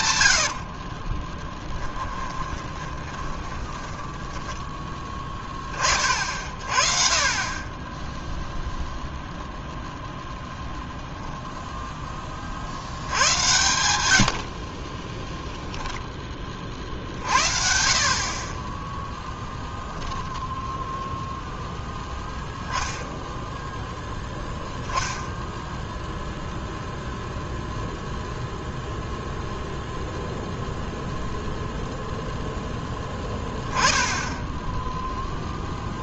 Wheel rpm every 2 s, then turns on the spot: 80, 20, 20, 50, 0, 0, 40, 50, 30, 30, 0, 10, 0, 0, 0, 0, 0, 10.
0-6